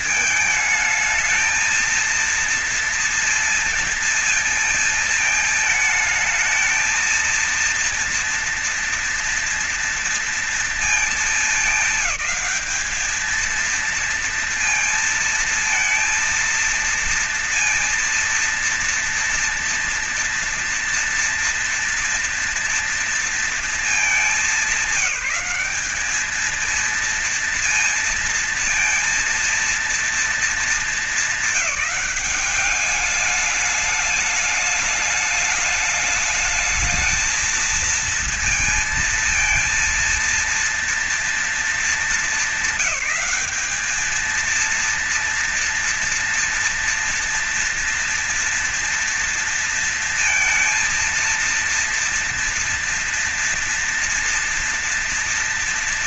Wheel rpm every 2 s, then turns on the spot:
220, 230, 220, 220, 230, 220, 220, 230, 230, 240, 230, 230, 210, 220, 230, 230, 210, 210, 220, 220, 230, 200, 230, 230, 230, 230, 230, 230.
none